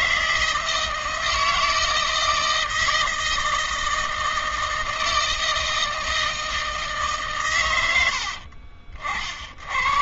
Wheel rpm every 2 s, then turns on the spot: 170, 160, 160, 150, 60.
none